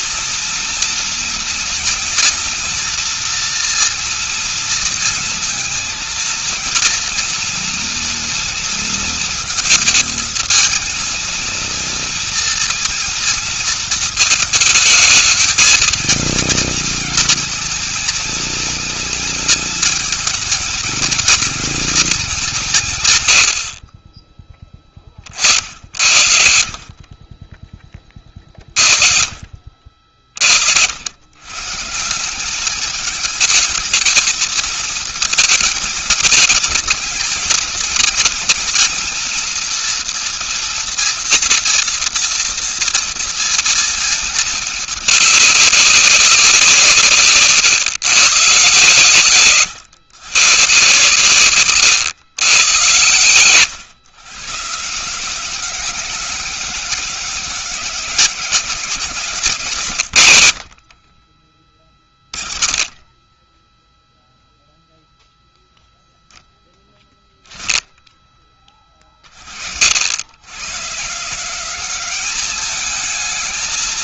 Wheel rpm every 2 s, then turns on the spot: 240, 230, 230, 230, 230, 220, 230, 220, 230, 230, 230, 140, 20, 40, 40, 90, 210, 220, 220, 230, 240, 230, 210, 160, 130, 120, 100, 160, 200, 190, 60, 20, 0, 10, 40, 140, 200.
60-62